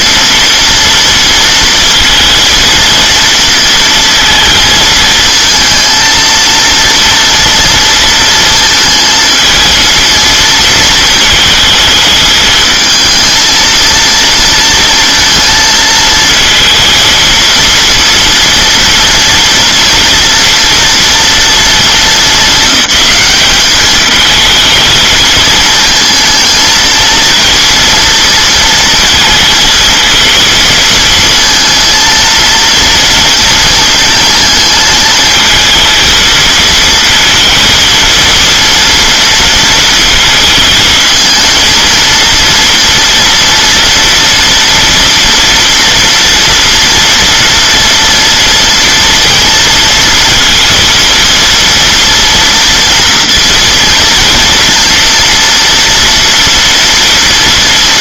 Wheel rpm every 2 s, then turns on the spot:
230, 230, 220, 230, 220, 230, 220, 230, 230, 230, 230, 210, 220, 230, 230, 230, 230, 230, 230, 230, 220, 230, 230, 230, 230, 230, 230, 230, 230.
none